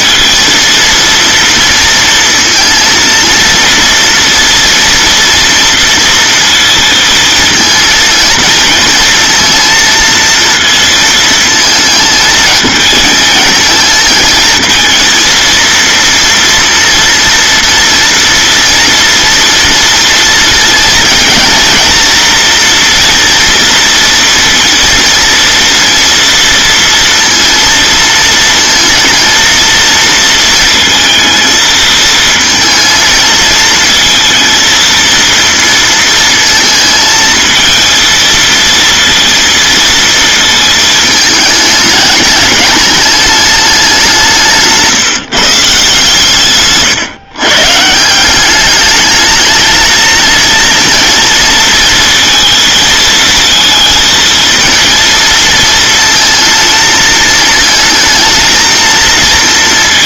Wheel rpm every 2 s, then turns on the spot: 230, 230, 230, 230, 230, 230, 220, 220, 230, 230, 230, 230, 230, 230, 230, 230, 220, 230, 230, 230, 220, 210, 150, 130, 200, 230, 230, 230, 230, 220.
none